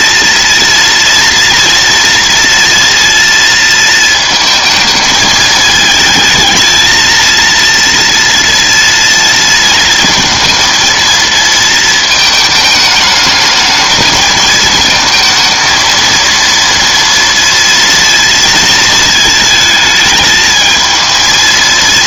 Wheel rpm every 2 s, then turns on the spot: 230, 230, 220, 230, 230, 230, 210, 220, 230, 220, 220.
none